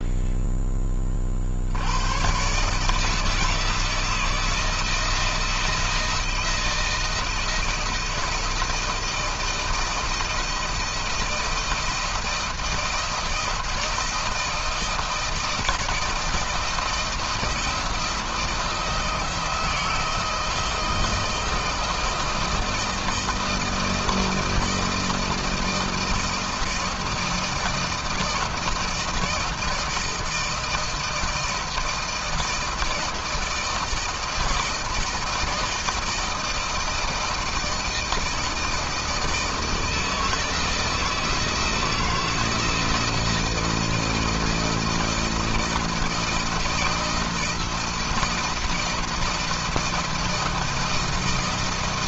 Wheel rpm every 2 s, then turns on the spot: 10, 140, 160, 170, 160, 160, 160, 160, 170, 160, 160, 160, 160, 160, 160, 160, 160, 160, 160, 160, 160, 170, 160, 170, 170, 160.
none